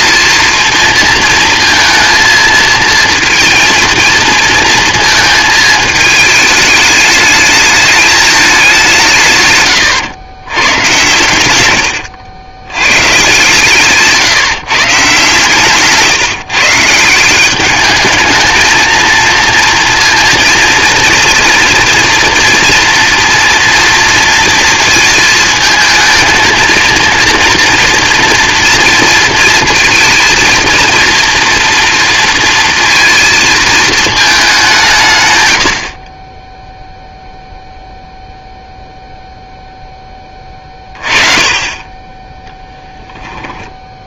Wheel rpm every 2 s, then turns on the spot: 230, 230, 230, 210, 190, 110, 110, 150, 150, 220, 230, 230, 230, 230, 230, 230, 230, 180, 0, 0, 30, 0.
none